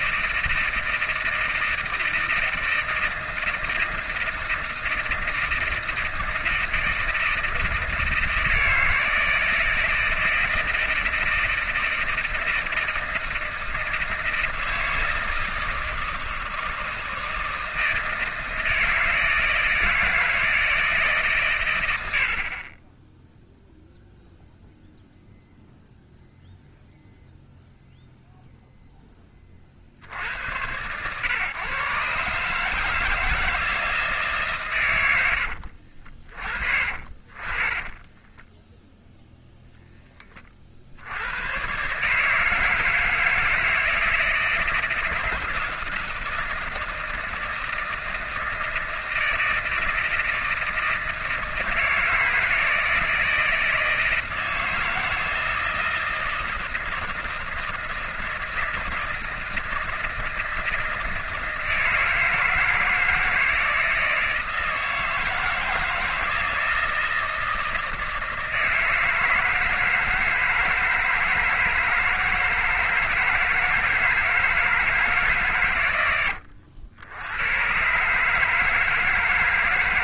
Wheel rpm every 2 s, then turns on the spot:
160, 160, 160, 160, 160, 160, 160, 160, 160, 160, 160, 40, 0, 0, 0, 100, 150, 140, 40, 10, 50, 160, 160, 160, 160, 160, 160, 160, 160, 160, 160, 160, 160, 160, 160, 160, 160, 160, 90, 150.
38-40